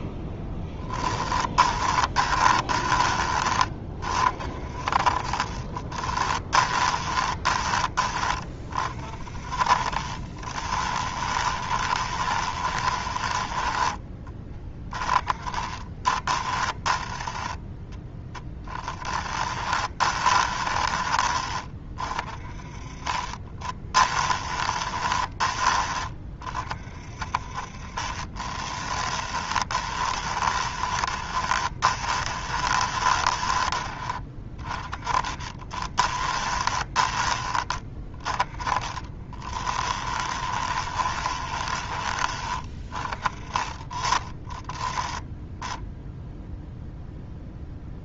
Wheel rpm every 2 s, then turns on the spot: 10, 20, 40, 20, 30, 20, 20, 20, 10, 10, 20, 40, 20, 40, 20, 20, 20, 20, 20, 30, 20, 20, 10, 0.
2-8 10-20 22-26 28-36 38-42